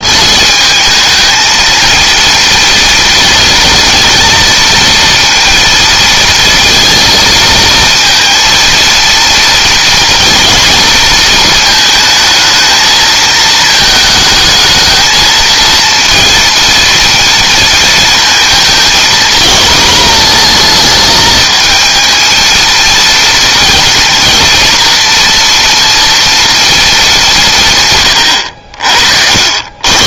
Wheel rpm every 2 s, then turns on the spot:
220, 230, 230, 230, 230, 230, 220, 220, 230, 220, 220, 230, 230, 210, 70.
none